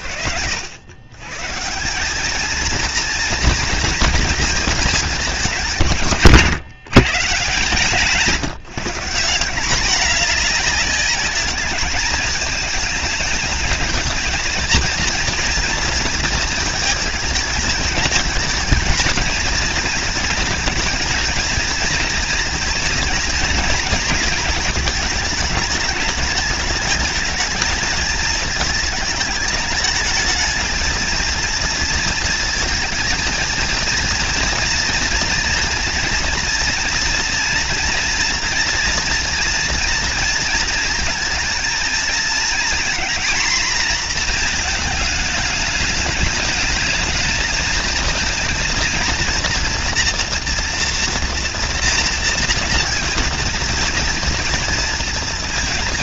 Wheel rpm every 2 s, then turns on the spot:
120, 230, 210, 170, 190, 210, 220, 230, 220, 220, 230, 220, 210, 220, 220, 230, 230, 230, 230, 230, 220, 240, 220, 220, 230, 230, 240, 230.
none